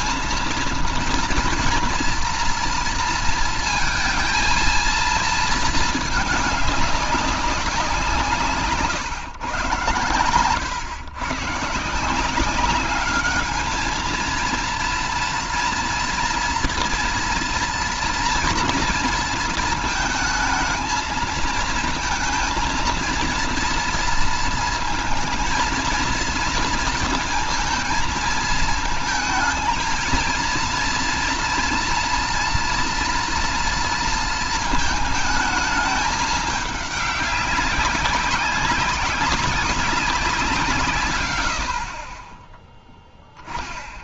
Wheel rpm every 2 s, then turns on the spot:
230, 230, 230, 200, 140, 110, 200, 230, 240, 230, 220, 230, 230, 230, 230, 230, 240, 220, 200, 190, 160, 10.
none